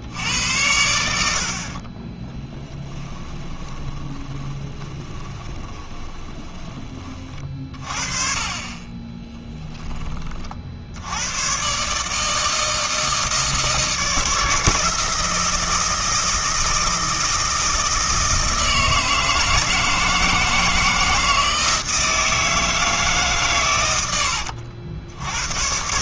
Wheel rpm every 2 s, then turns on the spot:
80, 10, 20, 30, 30, 70, 160, 160, 160, 160, 160, 160, 70.
2-6